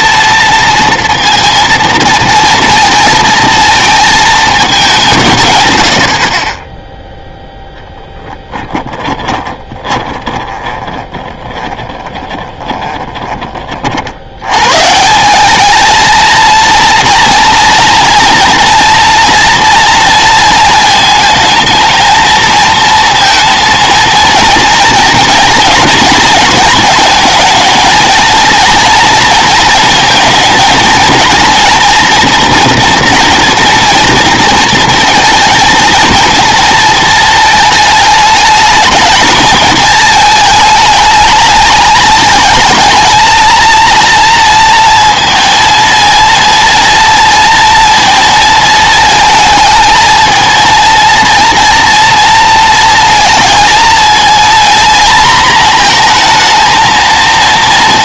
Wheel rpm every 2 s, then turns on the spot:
230, 230, 210, 20, 10, 20, 20, 130, 230, 240, 230, 230, 230, 230, 230, 230, 230, 230, 230, 210, 220, 220, 230, 230, 230, 230, 230, 230, 230.
8-14